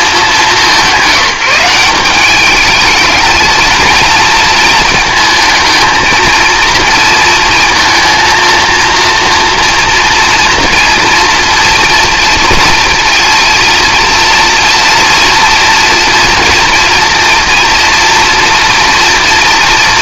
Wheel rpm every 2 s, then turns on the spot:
180, 210, 220, 230, 230, 230, 230, 230, 230, 230.
none